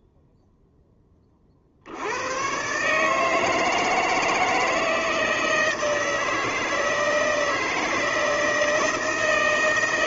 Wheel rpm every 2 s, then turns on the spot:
0, 130, 160, 160, 160.
none